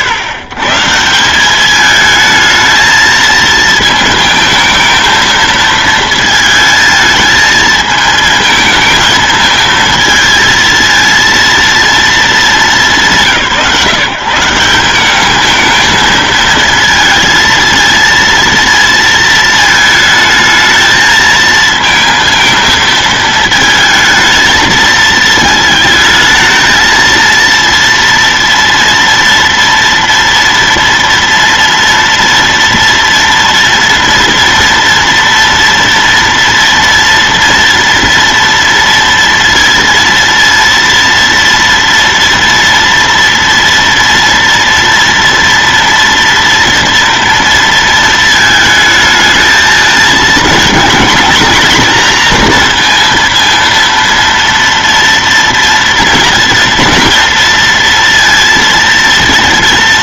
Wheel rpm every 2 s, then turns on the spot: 150, 220, 220, 220, 220, 230, 200, 180, 230, 230, 220, 220, 220, 220, 230, 230, 230, 230, 230, 230, 230, 230, 230, 230, 220, 220, 230, 230, 230, 230.
none